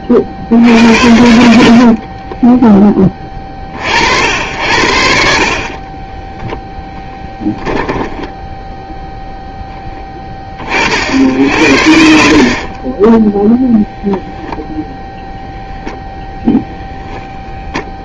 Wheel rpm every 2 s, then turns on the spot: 70, 20, 70, 0, 0, 40, 30, 0, 0.
12-14